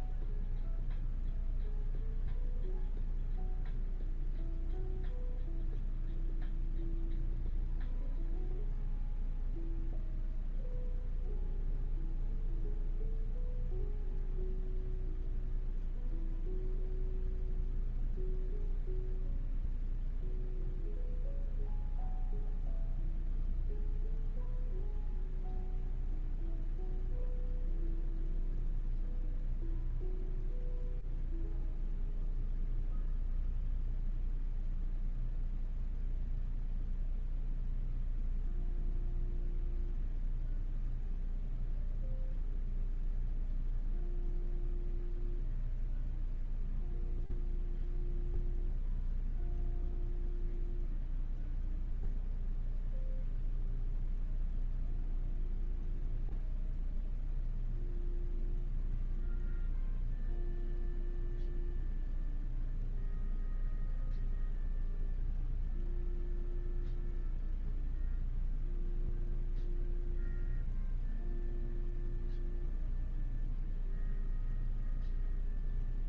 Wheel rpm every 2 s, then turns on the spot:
0, 0, 0, 0, 0, 0, 0, 0, 0, 0, 0, 0, 0, 0, 0, 0, 0, 0, 0, 0, 0, 0, 0, 0, 0, 0, 0, 0, 0, 0, 0, 0, 0, 0, 0, 0, 0, 0.
none